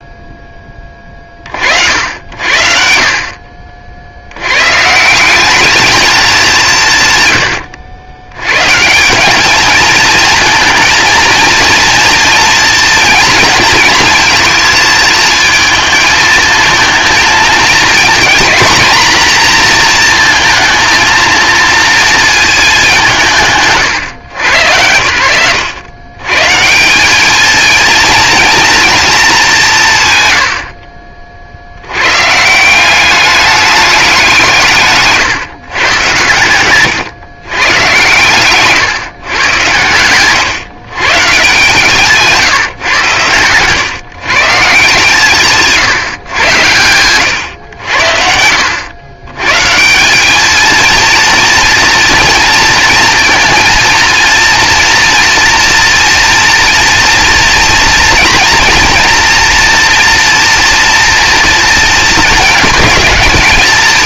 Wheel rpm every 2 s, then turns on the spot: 30, 70, 130, 170, 130, 230, 230, 220, 220, 240, 230, 210, 100, 180, 240, 70, 160, 160, 110, 130, 120, 150, 150, 110, 80, 220, 230, 230, 240, 230, 230, 220.
38-40